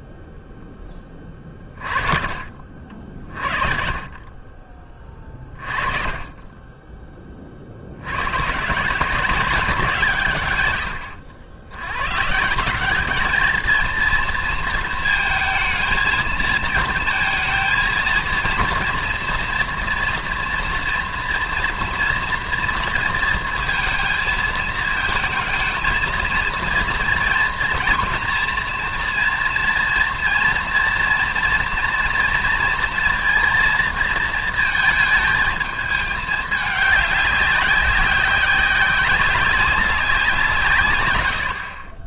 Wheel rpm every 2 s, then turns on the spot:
10, 50, 30, 20, 150, 110, 200, 230, 220, 230, 230, 230, 220, 230, 230, 230, 230, 220, 210, 190, 120.
none